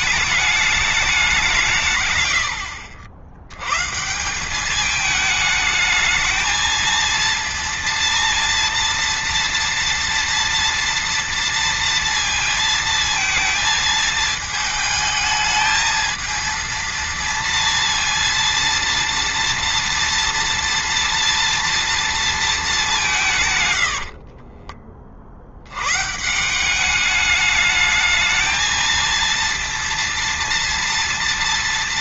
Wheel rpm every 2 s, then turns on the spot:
210, 80, 210, 230, 230, 230, 230, 220, 230, 230, 230, 200, 50, 200, 230, 230.
none